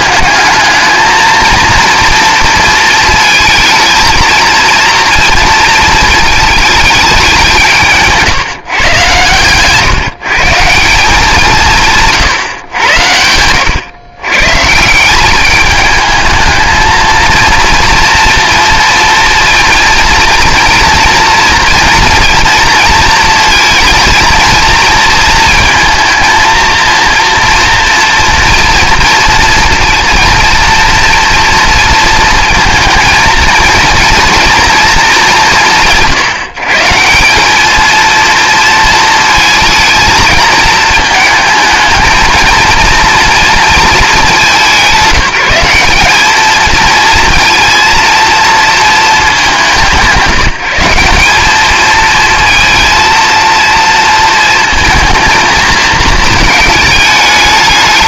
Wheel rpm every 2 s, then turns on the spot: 210, 230, 230, 210, 140, 170, 110, 160, 220, 230, 230, 230, 230, 230, 240, 230, 230, 230, 160, 230, 220, 230, 190, 220, 230, 170, 230, 230, 220.
none